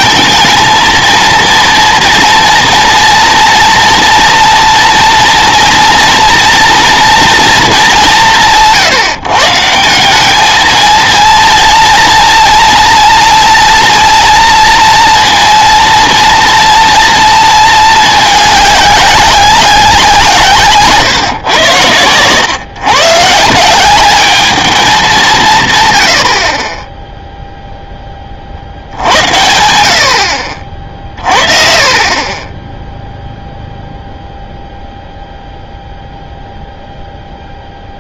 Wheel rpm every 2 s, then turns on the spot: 220, 230, 230, 240, 130, 220, 230, 230, 230, 200, 150, 120, 210, 30, 60, 40, 10, 0, 0.
none